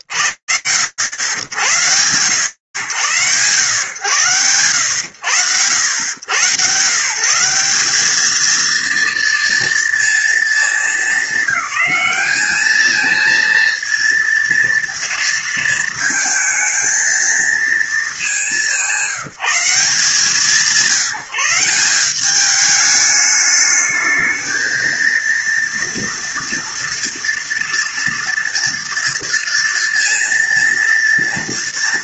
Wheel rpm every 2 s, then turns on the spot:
90, 110, 100, 210, 230, 210, 230, 220, 210, 180, 190, 220, 230, 230, 230, 230.
none